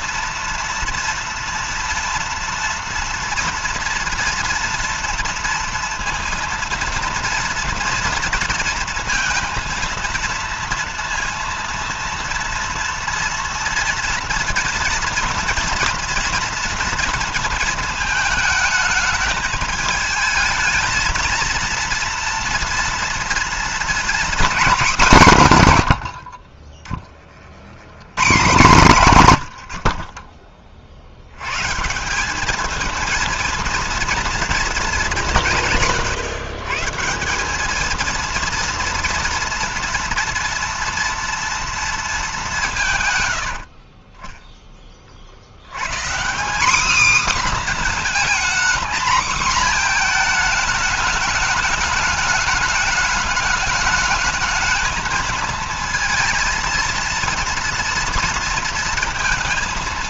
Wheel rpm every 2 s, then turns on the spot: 230, 230, 230, 230, 230, 230, 230, 230, 230, 220, 220, 230, 250, 70, 170, 60, 190, 230, 140, 230, 230, 200, 20, 200, 250, 230, 210, 220, 230, 230.
26-28 30-32